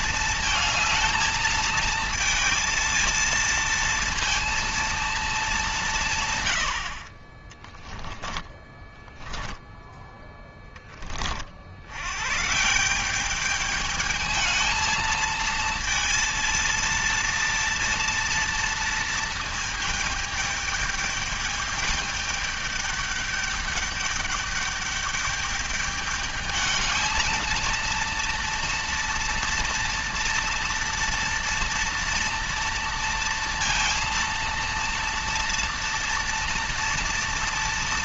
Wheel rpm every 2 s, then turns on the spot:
230, 230, 230, 130, 10, 0, 130, 220, 230, 230, 210, 210, 210, 210, 230, 230, 230, 230, 230.
8-10